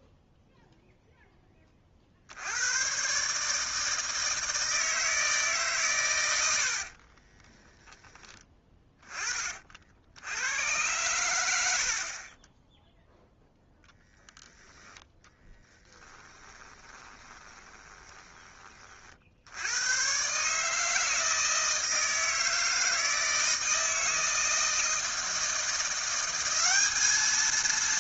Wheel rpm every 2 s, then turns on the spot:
0, 90, 160, 80, 20, 100, 10, 10, 20, 20, 150, 160, 160, 190.
6-8 16-18